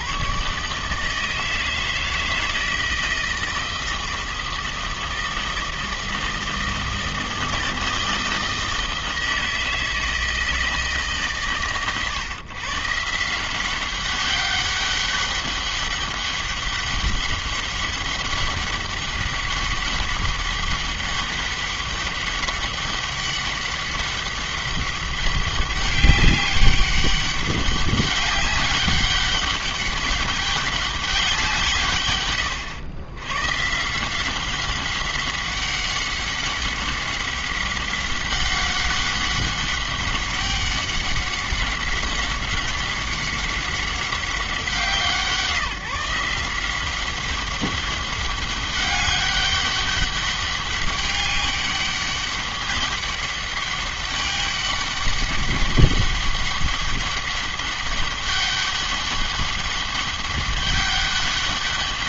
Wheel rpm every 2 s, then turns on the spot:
150, 160, 160, 160, 160, 160, 140, 200, 200, 200, 200, 200, 200, 200, 200, 200, 100, 190, 190, 190, 190, 190, 180, 180, 200, 200, 200, 200, 200, 200, 200.
none